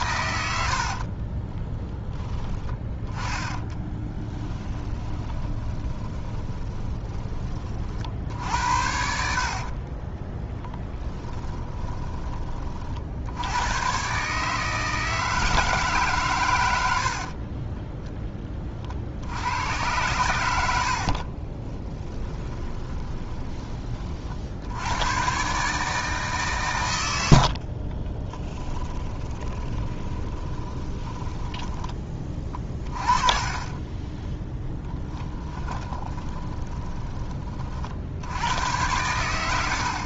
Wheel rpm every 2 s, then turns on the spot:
70, 10, 10, 20, 70, 10, 50, 150, 70, 60, 70, 20, 90, 110, 20, 20, 30, 10, 20, 100.
0-8 10-12 20-24 28-38